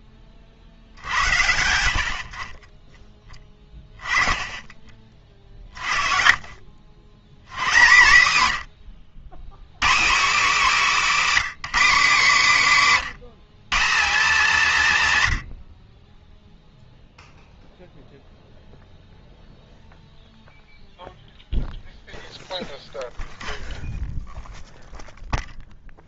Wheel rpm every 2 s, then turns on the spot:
40, 30, 30, 70, 110, 250, 190, 190, 0, 0, 0, 0, 0.
6-8